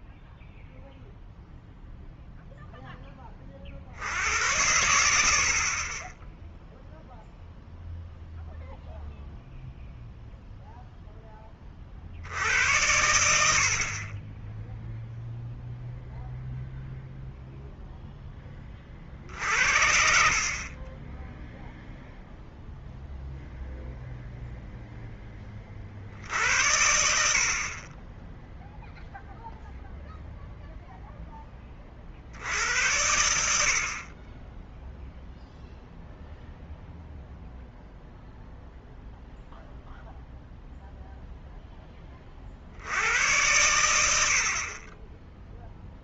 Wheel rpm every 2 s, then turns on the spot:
0, 0, 80, 0, 0, 0, 80, 10, 0, 30, 30, 0, 0, 70, 0, 0, 80, 10, 0, 0, 0, 70, 40.
none